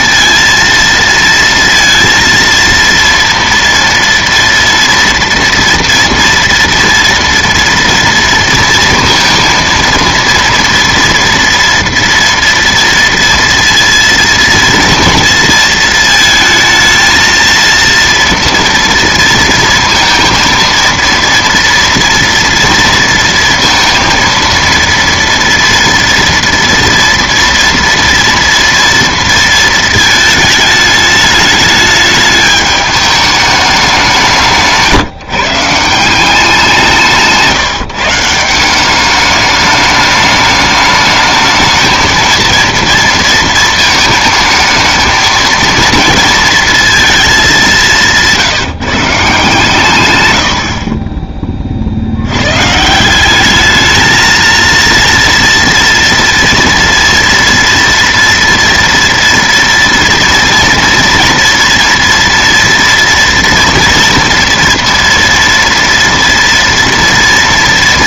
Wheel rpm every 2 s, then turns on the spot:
230, 230, 230, 230, 230, 230, 230, 230, 220, 230, 230, 230, 230, 240, 230, 210, 210, 150, 180, 180, 210, 230, 220, 230, 160, 70, 130, 230, 230, 240, 230, 240, 230, 230.
none